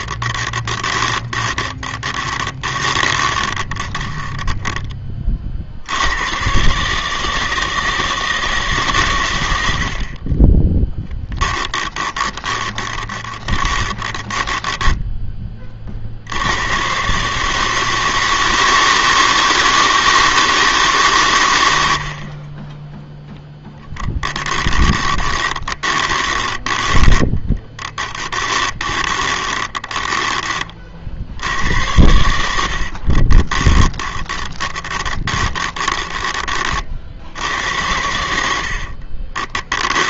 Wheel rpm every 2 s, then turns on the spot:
20, 20, 20, 150, 140, 10, 20, 10, 120, 160, 150, 10, 20, 30, 20, 50, 50, 20, 50, 50.
0-4 12-16 22-30 32-36 38-40